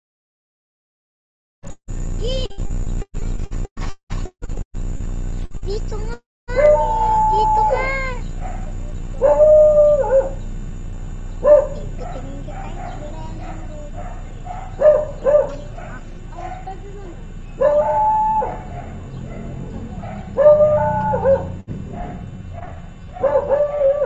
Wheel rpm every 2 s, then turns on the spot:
0, 0, 10, 0, 0, 0, 0, 0, 0, 0, 0, 0.
4-6